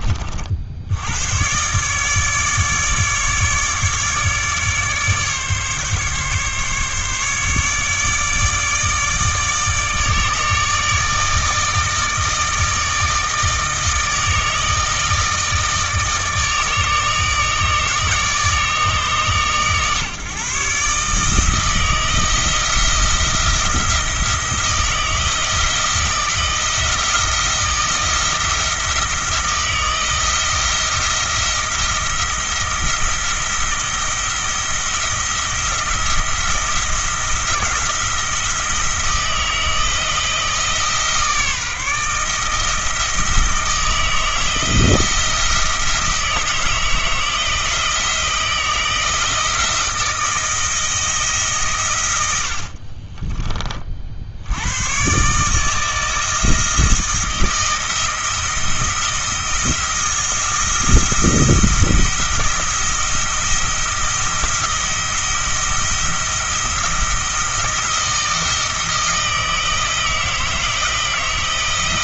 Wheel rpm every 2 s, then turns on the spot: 80, 150, 150, 140, 150, 150, 160, 160, 150, 150, 140, 170, 160, 170, 170, 170, 160, 170, 170, 160, 160, 160, 170, 160, 160, 160, 50, 110, 160, 170, 170, 170, 170, 170, 160, 160.
52-54